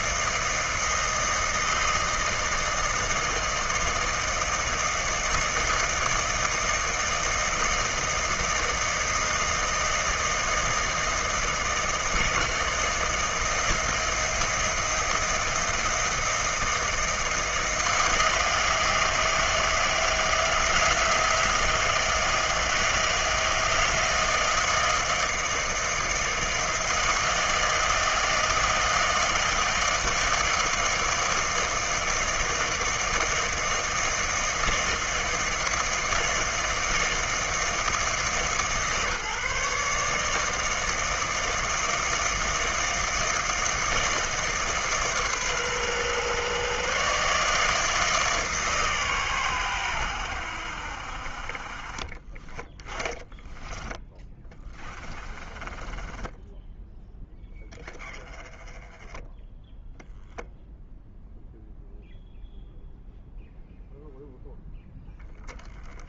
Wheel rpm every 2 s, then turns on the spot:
160, 160, 160, 160, 160, 160, 160, 170, 160, 160, 160, 160, 160, 160, 160, 160, 160, 160, 160, 150, 160, 160, 150, 130, 150, 70, 30, 20, 10, 20, 10, 0, 10.
52-58